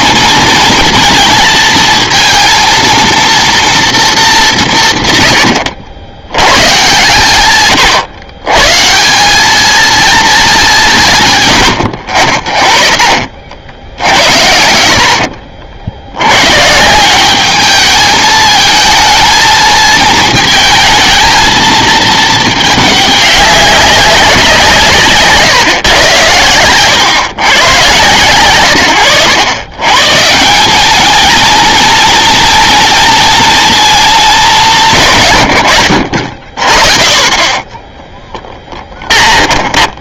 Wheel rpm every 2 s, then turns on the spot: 230, 230, 170, 130, 140, 210, 40, 80, 130, 220, 220, 210, 170, 110, 110, 180, 230, 190, 40, 10.
38-40